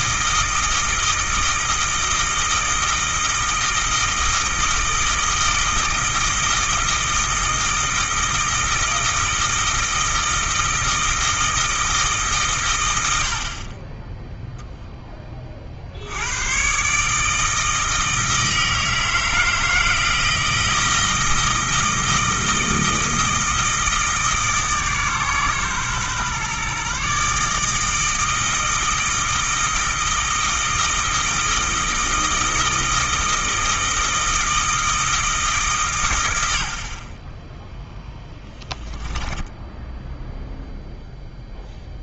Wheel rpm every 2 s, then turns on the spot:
160, 160, 160, 160, 160, 160, 110, 0, 130, 160, 160, 160, 150, 140, 160, 160, 160, 160, 50, 10, 0.
38-40